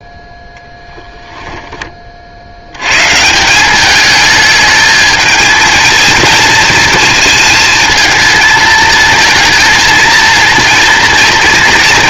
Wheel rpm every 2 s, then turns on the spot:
10, 130, 220, 220, 230, 230.
0-2